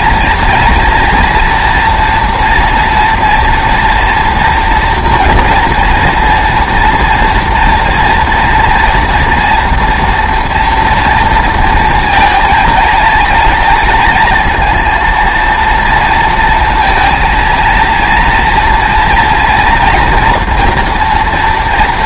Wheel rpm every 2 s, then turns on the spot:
230, 240, 230, 230, 230, 230, 220, 230, 230, 230, 240.
none